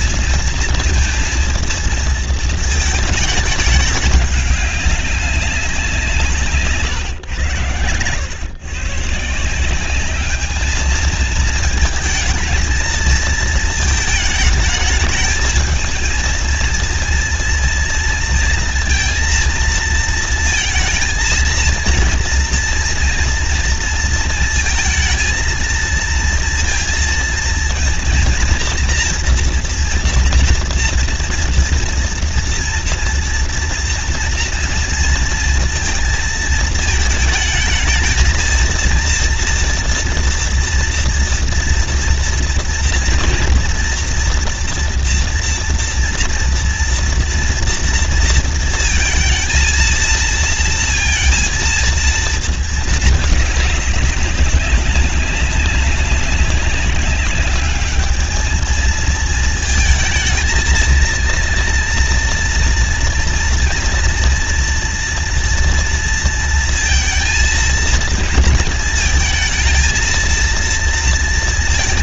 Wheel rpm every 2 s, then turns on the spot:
230, 220, 200, 140, 130, 220, 230, 220, 230, 230, 230, 240, 230, 230, 230, 230, 230, 230, 220, 230, 230, 230, 230, 230, 230, 230, 220, 200, 200, 220, 220, 230, 240, 230, 230, 230.
none